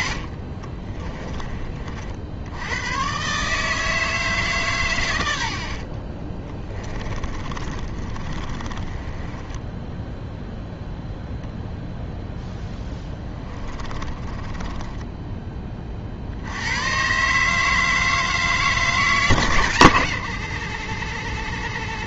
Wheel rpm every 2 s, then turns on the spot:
40, 100, 130, 20, 20, 0, 10, 10, 110, 150, 60.
0-2 6-10 12-16